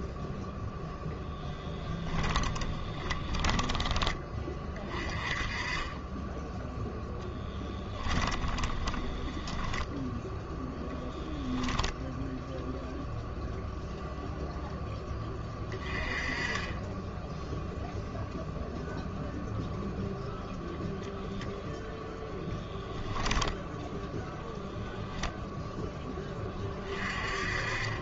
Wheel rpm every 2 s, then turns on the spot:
0, 20, 30, 0, 10, 0, 0, 10, 20, 0, 0, 10, 0, 30.
2-4 8-10